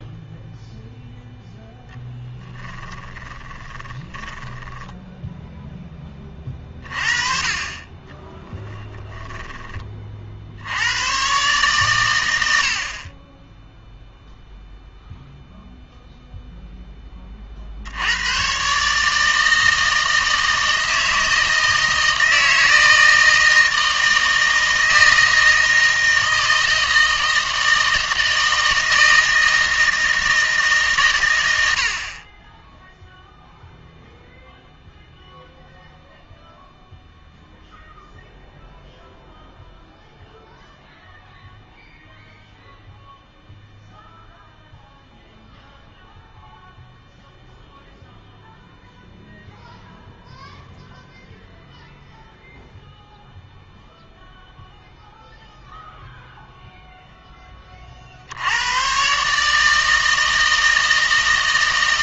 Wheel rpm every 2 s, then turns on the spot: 0, 10, 10, 40, 10, 80, 60, 0, 10, 130, 160, 160, 160, 160, 160, 150, 10, 0, 0, 0, 0, 0, 0, 0, 0, 0, 0, 0, 0, 110, 160.
2-6 8-10